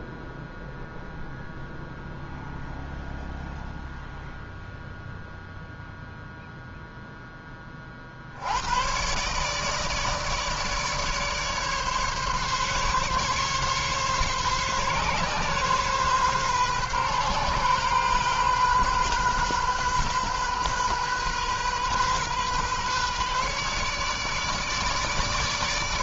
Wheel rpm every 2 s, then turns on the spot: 0, 0, 0, 0, 110, 150, 140, 140, 130, 130, 130, 130, 150.
none